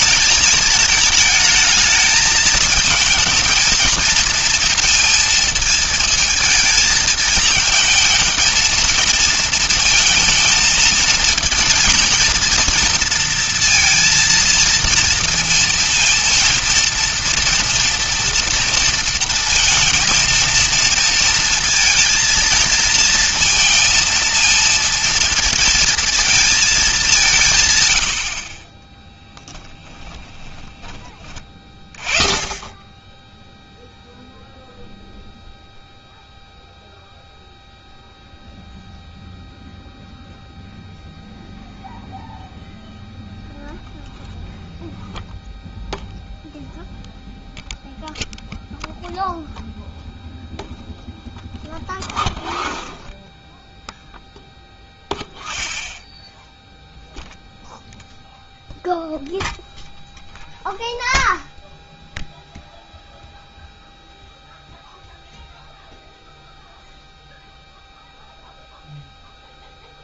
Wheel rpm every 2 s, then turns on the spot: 220, 220, 230, 220, 220, 220, 230, 230, 230, 230, 230, 230, 230, 210, 20, 20, 20, 0, 0, 0, 0, 0, 0, 0, 0, 0, 0, 0, 0, 0, 0, 0, 0, 0, 0.
30-32